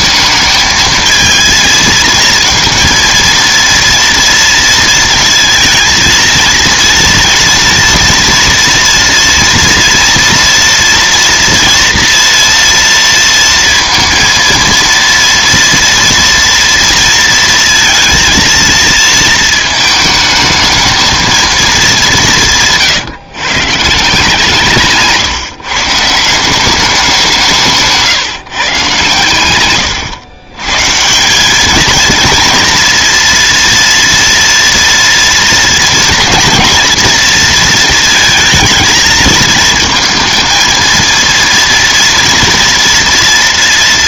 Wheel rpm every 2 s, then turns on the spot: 220, 230, 230, 230, 230, 240, 230, 230, 230, 230, 220, 160, 170, 190, 150, 120, 230, 230, 240, 220, 230, 230.
none